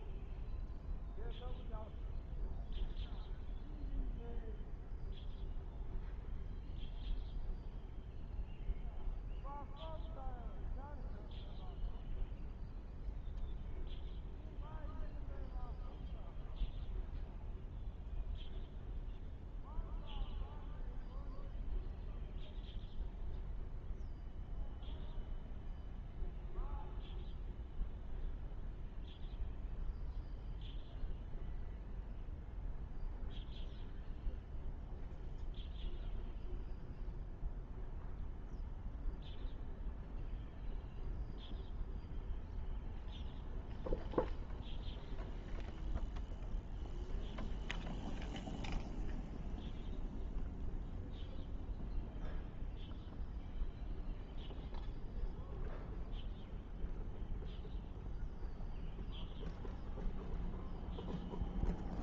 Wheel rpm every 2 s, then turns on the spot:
0, 0, 0, 0, 0, 0, 0, 0, 0, 0, 0, 0, 0, 0, 0, 0, 0, 0, 0, 0, 0, 0, 0, 0, 0, 0, 0, 0, 0, 0, 0.
none